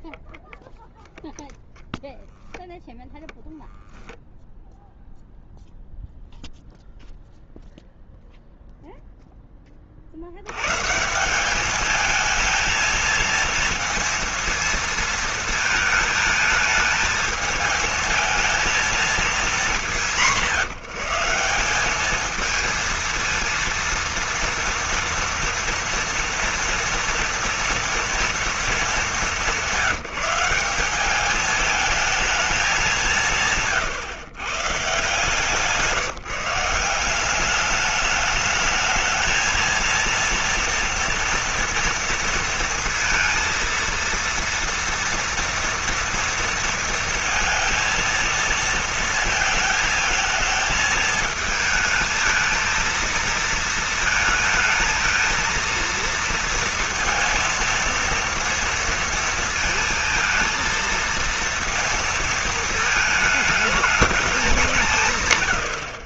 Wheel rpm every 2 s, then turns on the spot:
0, 0, 10, 0, 0, 90, 220, 230, 220, 220, 170, 220, 230, 240, 230, 180, 210, 120, 160, 210, 230, 230, 230, 230, 230, 220, 220, 220, 230, 230, 230, 220, 190.
none